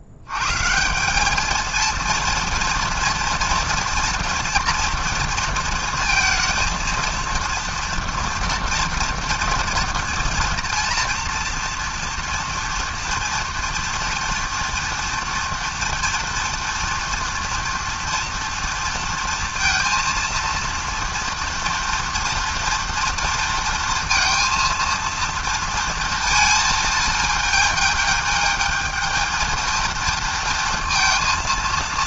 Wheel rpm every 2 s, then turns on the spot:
200, 230, 230, 230, 230, 230, 230, 230, 230, 230, 230, 230, 230, 220, 230, 230.
none